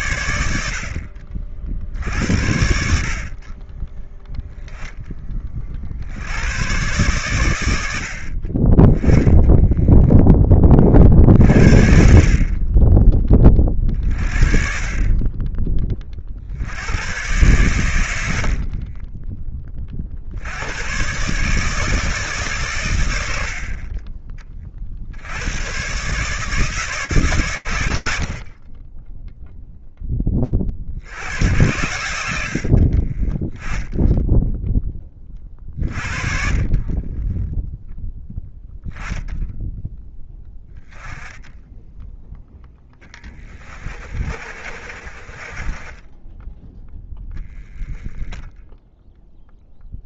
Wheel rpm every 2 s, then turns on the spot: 60, 50, 10, 110, 10, 40, 30, 30, 100, 30, 120, 80, 60, 150, 10, 80, 30, 20, 10, 0, 10, 10, 40, 10, 0.
18-20 42-46